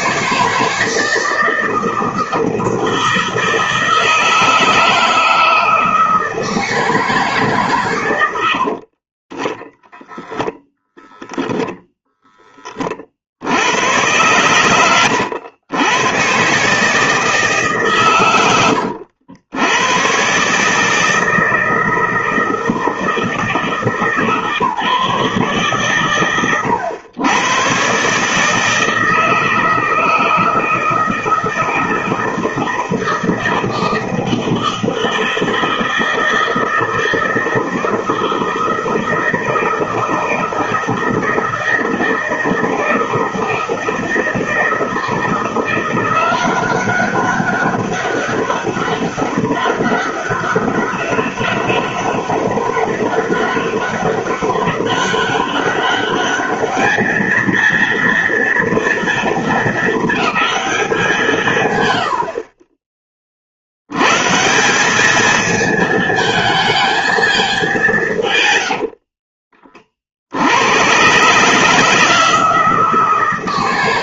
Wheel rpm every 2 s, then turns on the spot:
160, 160, 160, 160, 90, 0, 10, 110, 130, 100, 140, 160, 150, 100, 150, 160, 160, 160, 160, 160, 160, 160, 160, 190, 200, 200, 200, 200, 210, 230, 210, 50, 190, 220, 120, 80, 160.
8-10 68-70